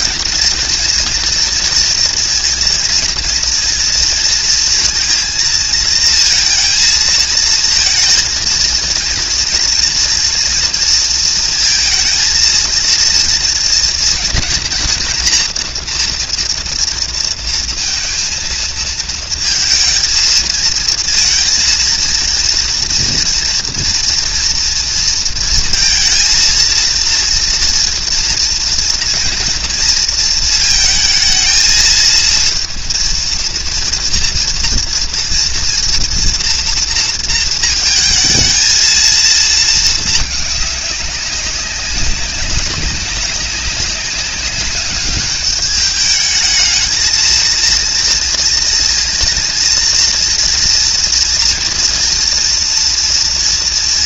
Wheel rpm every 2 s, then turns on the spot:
230, 230, 230, 230, 230, 230, 230, 240, 230, 230, 230, 230, 230, 230, 230, 230, 230, 230, 230, 220, 210, 190, 190, 220, 230, 230, 230.
none